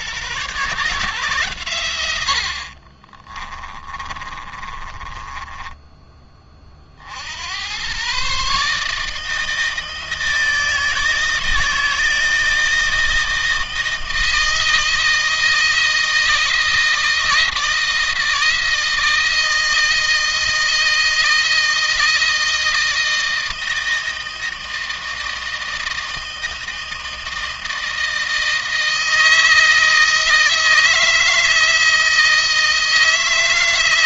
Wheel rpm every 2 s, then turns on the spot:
140, 50, 30, 30, 150, 160, 160, 160, 160, 160, 160, 160, 160, 160, 160, 160, 160.
2-6